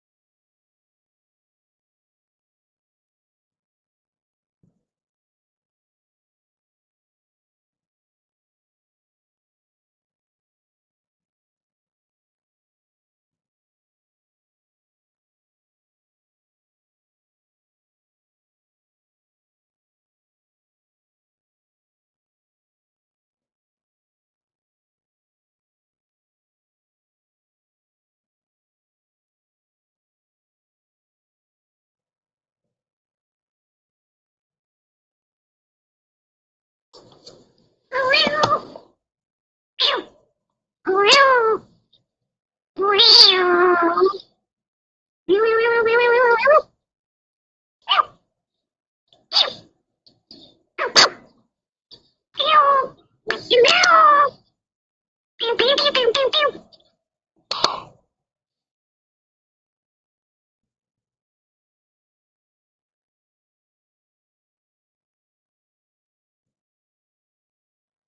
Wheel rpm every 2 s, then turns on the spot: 0, 0, 0, 0, 0, 0, 0, 0, 0, 0, 0, 0, 0, 0, 0, 0, 0, 0, 0, 0, 0, 0, 0, 0, 0, 0, 0, 0, 0, 0, 0, 0, 0, 0.
none